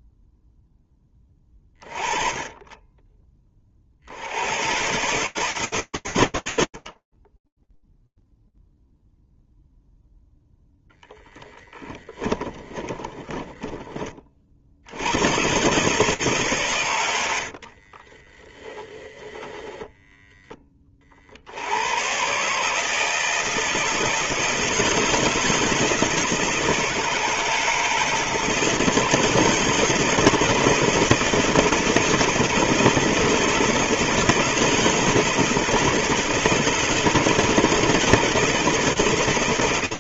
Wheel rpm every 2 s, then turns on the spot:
0, 30, 110, 90, 0, 0, 20, 40, 140, 20, 20, 150, 160, 170, 160, 160, 160, 160, 160, 160.
12-14 18-20